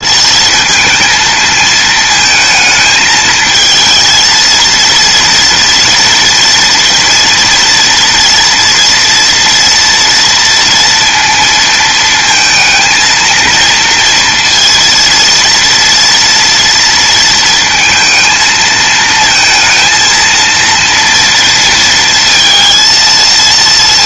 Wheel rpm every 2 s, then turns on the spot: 220, 220, 230, 230, 240, 230, 230, 230, 230, 220, 230, 230.
none